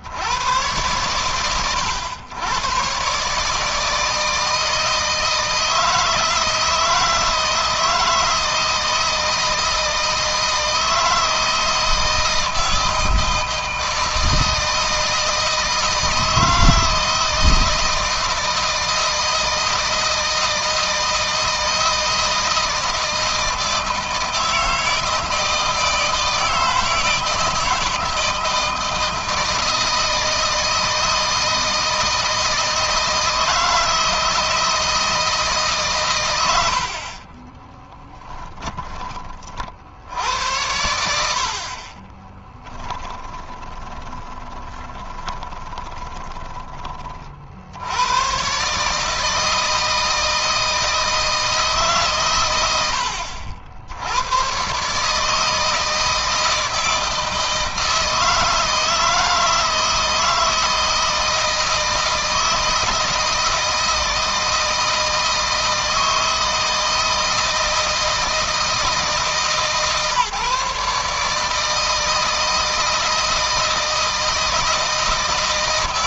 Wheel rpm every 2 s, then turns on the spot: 100, 110, 160, 160, 160, 160, 160, 160, 160, 160, 160, 160, 160, 160, 160, 160, 160, 160, 90, 20, 90, 10, 10, 20, 130, 160, 110, 120, 160, 160, 160, 160, 160, 160, 160, 150, 160, 160.
38-40 42-46